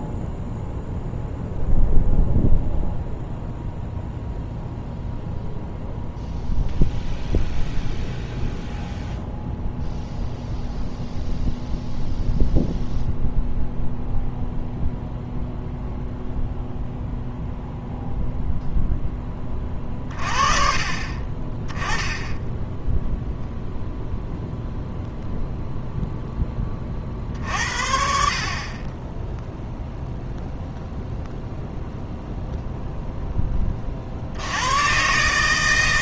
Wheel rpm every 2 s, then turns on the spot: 0, 0, 0, 0, 0, 0, 0, 0, 0, 0, 30, 10, 0, 30, 20, 0, 0, 100.
none